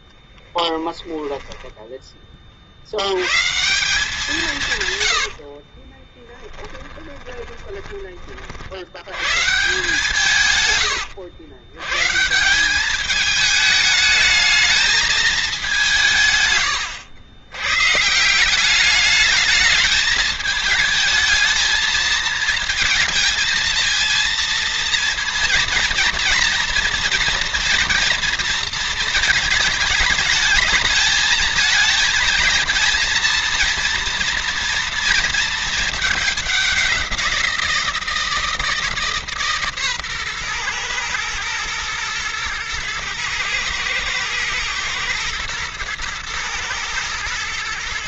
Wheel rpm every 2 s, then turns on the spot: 10, 70, 140, 10, 90, 110, 190, 220, 110, 190, 220, 220, 230, 230, 230, 220, 220, 230, 200, 160, 120, 110, 110, 110.
0-2 4-8